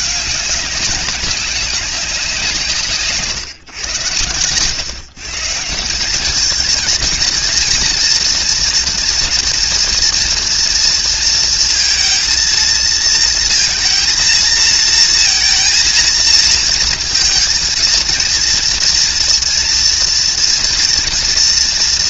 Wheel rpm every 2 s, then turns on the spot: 210, 170, 110, 220, 240, 230, 230, 230, 230, 230, 230.
none